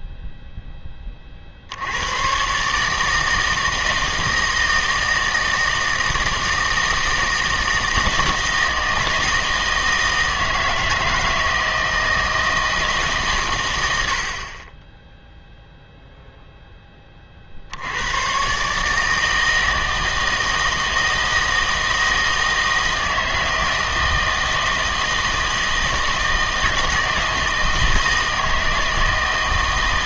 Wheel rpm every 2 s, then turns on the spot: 10, 140, 160, 160, 160, 160, 160, 20, 10, 140, 160, 160, 160, 160, 160.
none